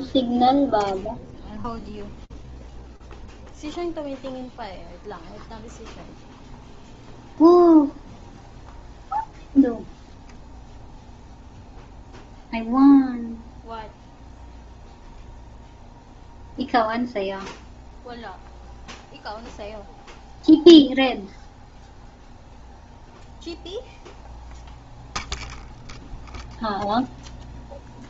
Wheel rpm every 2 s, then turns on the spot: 0, 0, 0, 0, 0, 0, 0, 0, 0, 0, 0, 0, 0, 0.
none